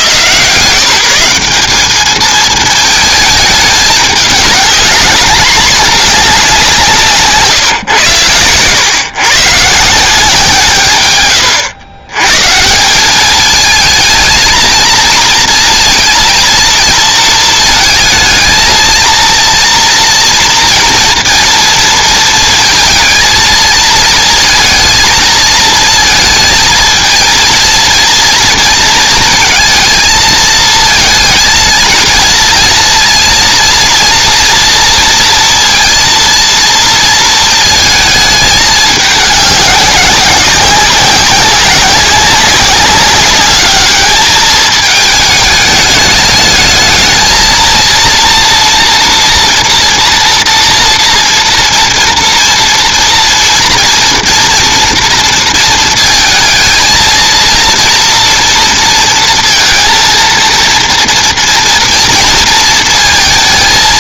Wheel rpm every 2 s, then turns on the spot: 160, 220, 210, 190, 120, 150, 170, 220, 230, 220, 230, 230, 230, 220, 230, 220, 230, 230, 230, 210, 190, 200, 210, 220, 240, 230, 230, 240, 230, 230, 230, 230.
none